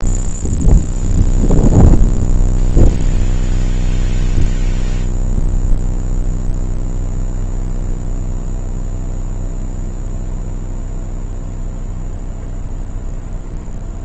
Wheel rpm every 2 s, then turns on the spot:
0, 0, 0, 0, 0, 0, 0.
none